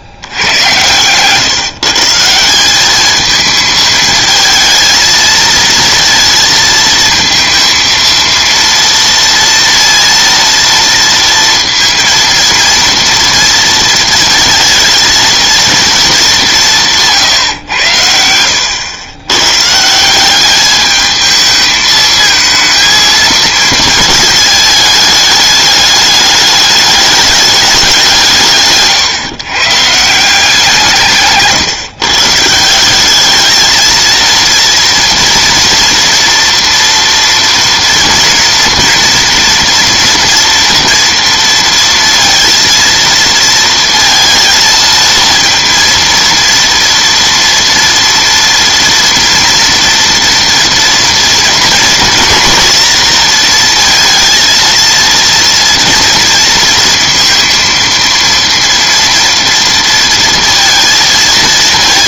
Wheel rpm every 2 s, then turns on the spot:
100, 190, 220, 230, 230, 230, 230, 230, 190, 100, 210, 220, 220, 210, 140, 180, 160, 230, 230, 230, 230, 230, 230, 230, 240, 230, 230, 230, 230, 230, 230.
28-30